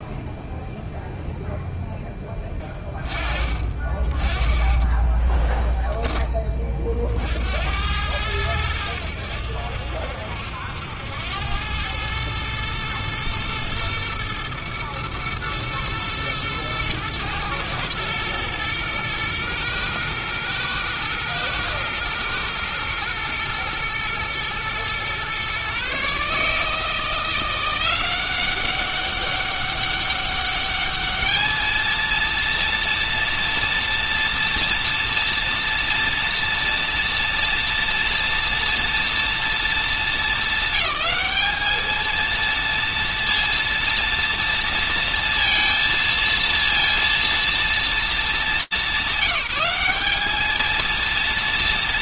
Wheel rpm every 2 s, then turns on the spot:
0, 20, 10, 30, 100, 80, 120, 120, 110, 110, 110, 110, 120, 150, 190, 210, 230, 230, 230, 230, 200, 230, 230, 230, 200, 220.
none